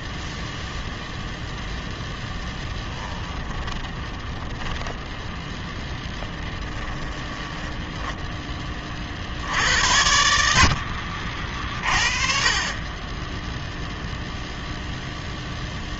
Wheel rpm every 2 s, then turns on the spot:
0, 20, 20, 20, 30, 50, 20, 0.
2-4 6-8